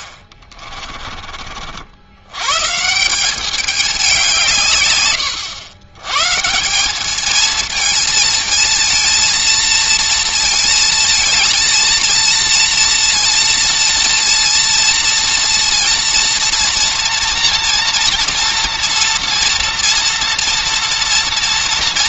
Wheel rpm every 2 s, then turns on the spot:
30, 160, 130, 180, 230, 220, 230, 230, 230, 240, 230.
0-2